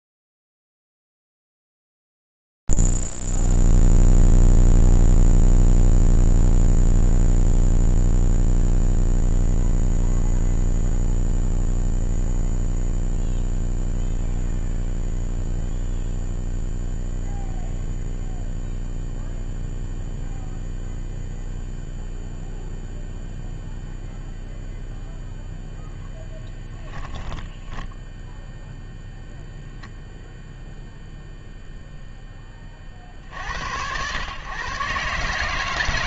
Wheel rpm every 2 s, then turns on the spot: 0, 0, 0, 0, 0, 0, 0, 0, 0, 0, 0, 0, 0, 10, 0, 0, 30, 120.
26-28